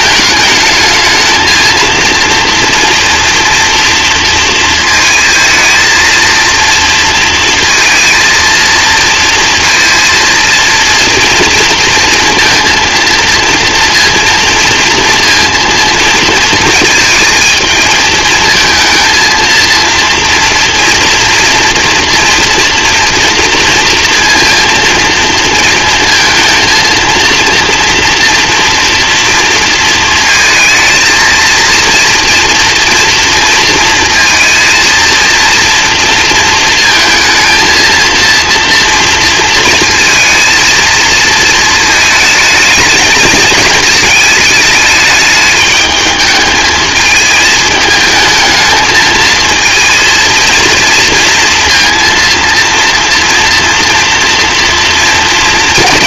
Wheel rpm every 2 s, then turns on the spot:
220, 230, 230, 230, 230, 230, 230, 230, 230, 220, 230, 230, 230, 220, 230, 220, 230, 230, 230, 230, 230, 220, 210, 220, 220, 230, 230, 230.
none